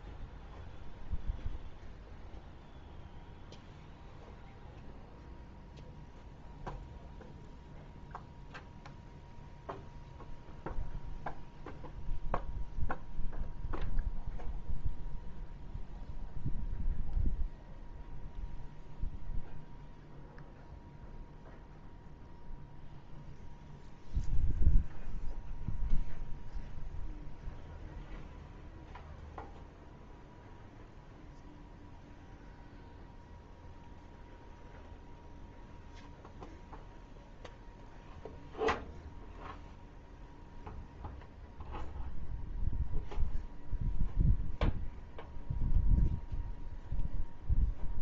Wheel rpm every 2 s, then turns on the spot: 0, 0, 0, 0, 0, 0, 0, 0, 0, 0, 0, 0, 0, 0, 0, 0, 0, 0, 0, 0, 0, 0, 0, 0.
none